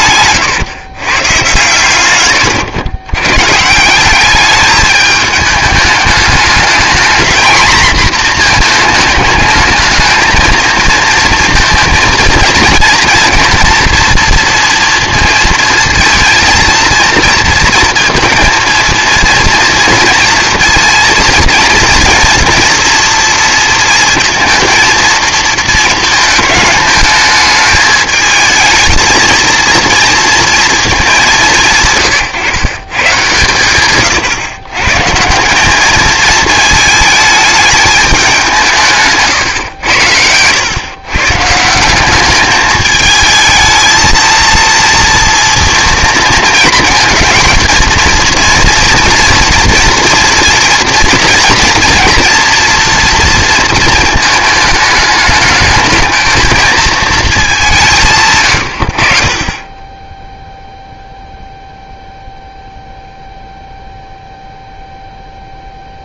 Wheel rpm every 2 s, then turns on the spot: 140, 130, 210, 220, 220, 230, 230, 230, 230, 230, 230, 230, 230, 210, 220, 210, 140, 140, 220, 160, 130, 220, 230, 220, 230, 230, 230, 210, 220, 70, 0, 0, 0.
38-40